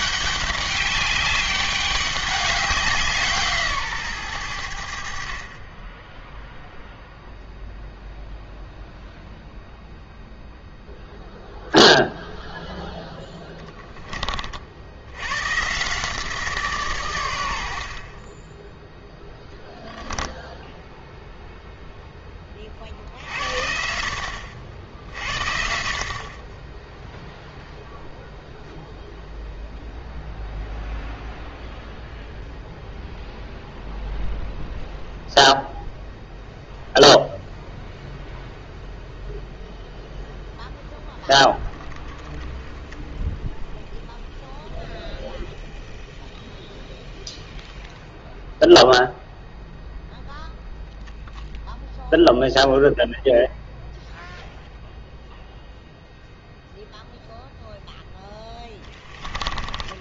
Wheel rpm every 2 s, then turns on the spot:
200, 190, 80, 0, 0, 0, 0, 70, 140, 10, 0, 40, 70, 10, 0, 0, 0, 0, 0, 0, 0, 10, 0, 0, 0, 0, 0, 0, 0, 10.
18-20